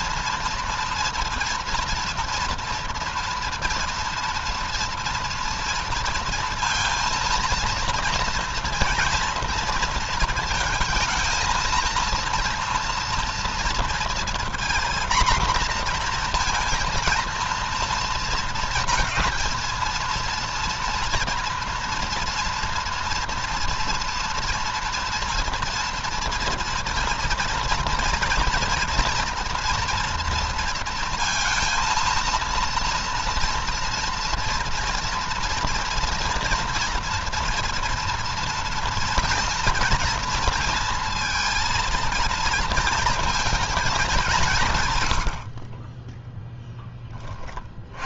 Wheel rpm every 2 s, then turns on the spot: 230, 230, 230, 230, 230, 220, 230, 240, 230, 230, 230, 230, 230, 230, 230, 230, 230, 230, 230, 230, 230, 230, 120, 20.
none